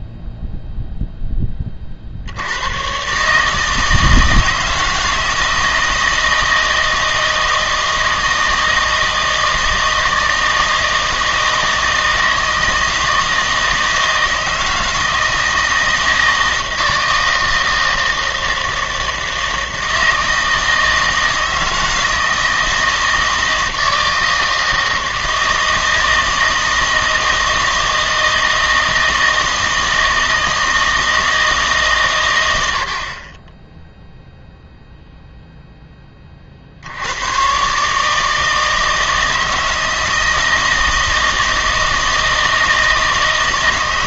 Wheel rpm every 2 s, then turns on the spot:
0, 90, 160, 160, 160, 160, 160, 160, 160, 160, 160, 160, 160, 160, 160, 160, 90, 0, 60, 160, 160, 160.
none